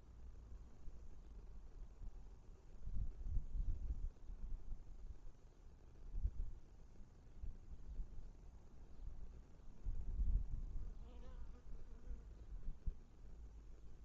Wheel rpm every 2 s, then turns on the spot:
0, 0, 0, 0, 0, 0, 0.
none